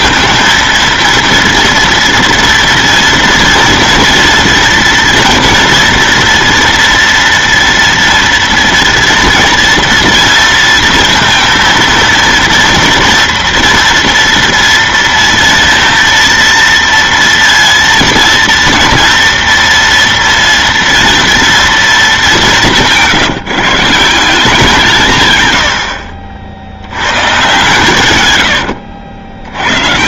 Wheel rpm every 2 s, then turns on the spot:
230, 230, 230, 230, 230, 230, 240, 230, 230, 230, 230, 200, 180, 80, 100.
28-30